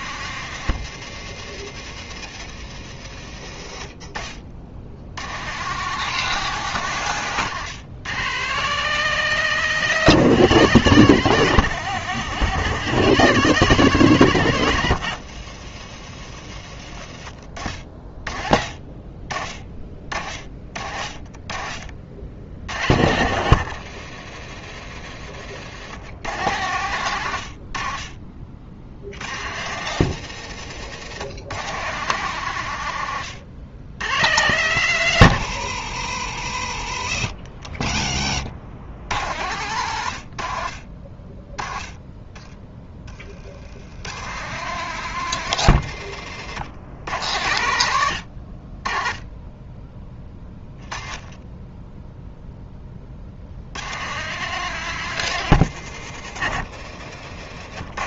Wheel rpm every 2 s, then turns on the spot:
130, 70, 90, 120, 160, 140, 140, 110, 60, 30, 30, 80, 80, 90, 80, 110, 100, 110, 50, 90, 30, 30, 150, 90, 20, 20, 50, 150, 100.
16-18 24-26 48-50 56-58